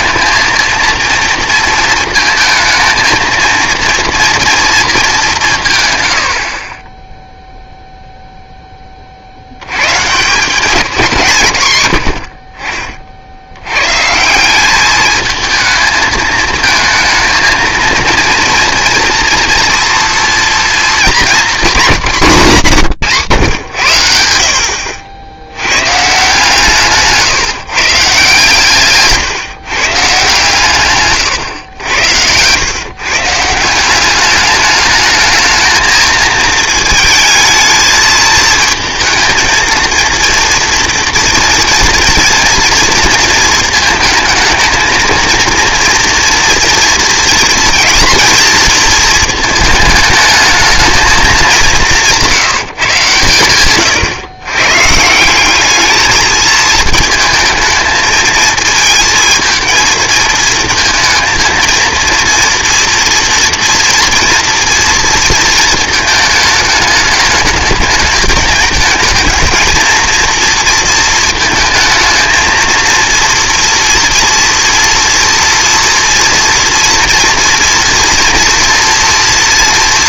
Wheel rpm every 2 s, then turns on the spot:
230, 220, 220, 20, 20, 190, 40, 200, 230, 230, 230, 200, 60, 160, 150, 130, 120, 210, 220, 220, 230, 230, 220, 230, 230, 220, 150, 130, 220, 220, 230, 240, 230, 220, 210, 230, 230, 230, 230, 230.
none